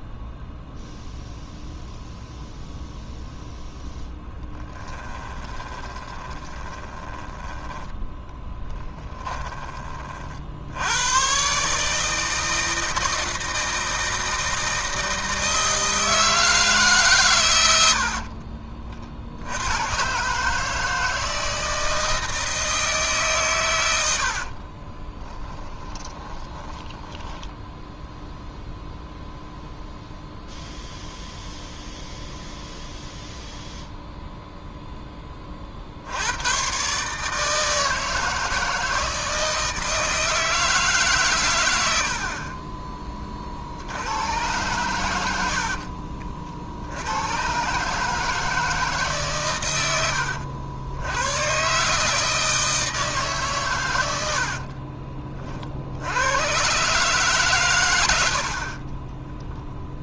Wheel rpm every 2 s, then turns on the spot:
0, 0, 10, 20, 20, 70, 160, 160, 160, 50, 150, 160, 40, 20, 0, 0, 0, 0, 120, 160, 160, 30, 110, 50, 160, 70, 160, 40, 120, 60.
4-10 18-20 24-28 54-56